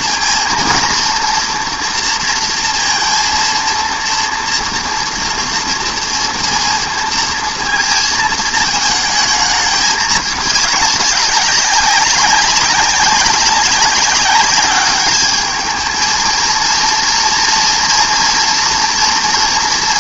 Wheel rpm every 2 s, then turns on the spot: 230, 230, 230, 230, 230, 210, 200, 190, 210, 230.
none